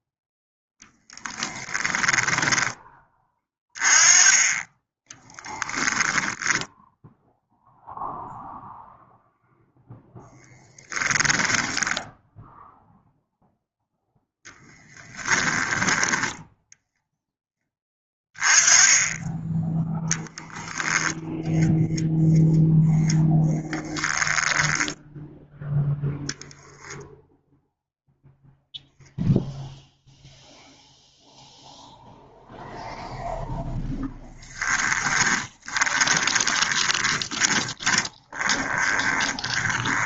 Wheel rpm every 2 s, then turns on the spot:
0, 10, 10, 0, 0, 10, 0, 10, 0, 20, 0, 0, 10, 10, 0, 0, 0, 20, 20, 30.
4-6 10-12 14-16 24-26 34-40